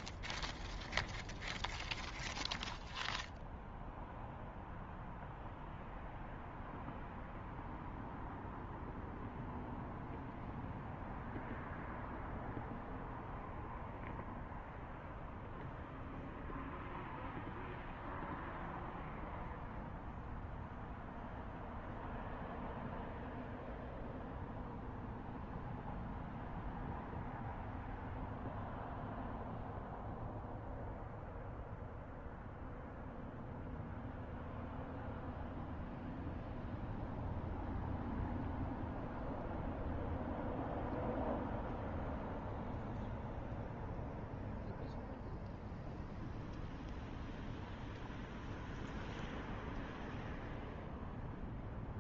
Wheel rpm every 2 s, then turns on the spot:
0, 0, 0, 0, 0, 0, 0, 0, 0, 0, 0, 0, 0, 0, 0, 0, 0, 0, 0, 0, 0, 0, 0, 0, 0, 0.
none